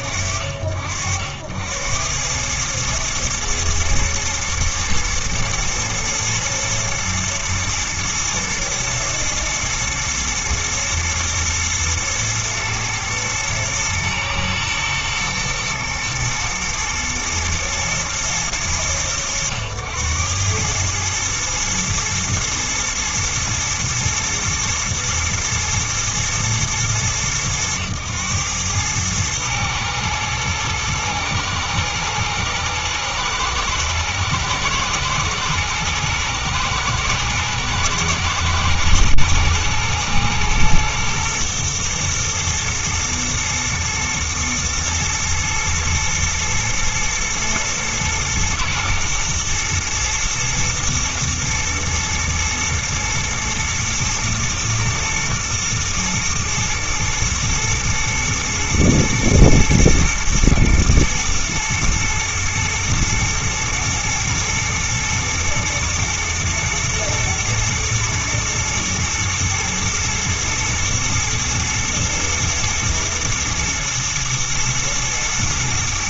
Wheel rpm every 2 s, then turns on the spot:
70, 110, 120, 120, 110, 120, 110, 110, 110, 100, 110, 120, 110, 110, 110, 110, 110, 120, 110, 120, 120, 120, 120, 110, 120, 110, 110, 110, 120, 110, 120, 110, 110, 120, 120, 120, 120, 110.
none